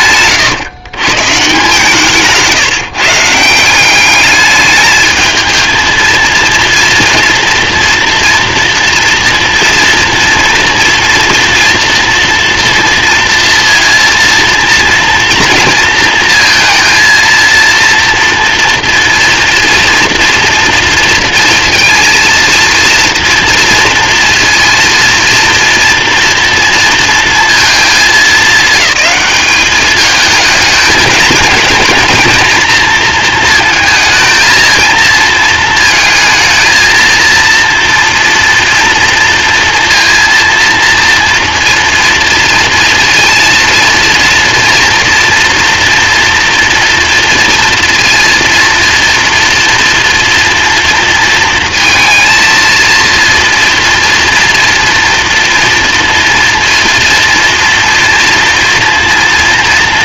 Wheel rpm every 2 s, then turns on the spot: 150, 170, 220, 230, 240, 230, 230, 230, 230, 230, 230, 230, 230, 220, 200, 220, 230, 230, 230, 230, 230, 230, 230, 230, 230, 230, 230, 240, 230, 230.
none